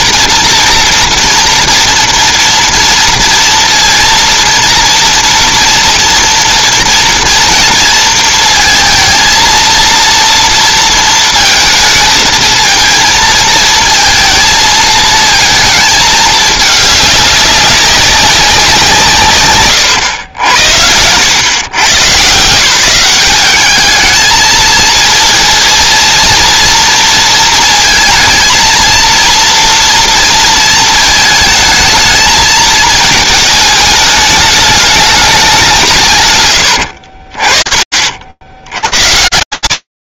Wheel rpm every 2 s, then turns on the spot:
230, 230, 230, 230, 230, 230, 220, 230, 210, 180, 80, 180, 220, 230, 230, 230, 220, 210, 100, 120.
36-38